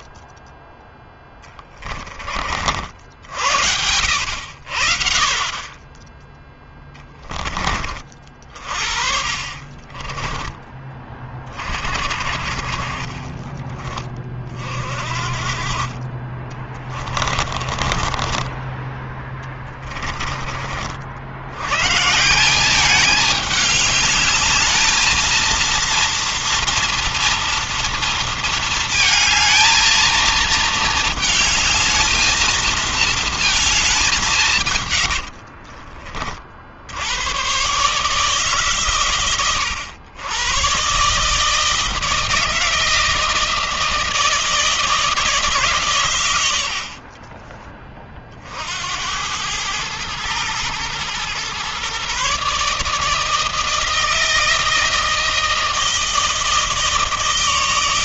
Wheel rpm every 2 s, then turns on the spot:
10, 40, 70, 10, 40, 20, 50, 30, 30, 20, 30, 170, 210, 230, 230, 220, 220, 170, 40, 140, 120, 160, 160, 100, 50, 110, 140, 160, 160.
16-22